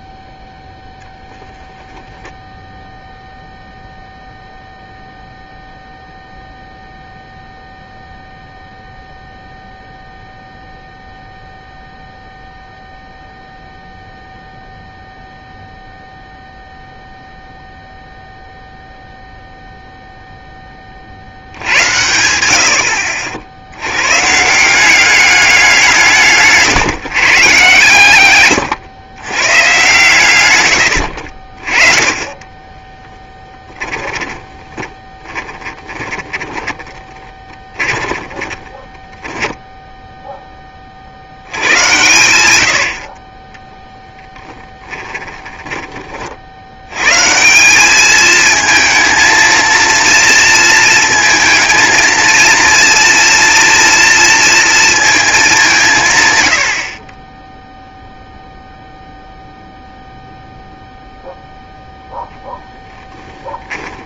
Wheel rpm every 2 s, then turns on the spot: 0, 0, 0, 0, 0, 0, 0, 0, 0, 0, 0, 70, 150, 160, 120, 110, 20, 30, 20, 20, 10, 100, 10, 60, 220, 230, 230, 230, 110, 0, 0, 0.
32-40